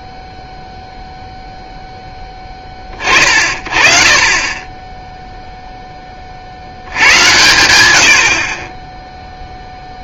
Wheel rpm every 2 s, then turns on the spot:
0, 50, 30, 100, 0.
none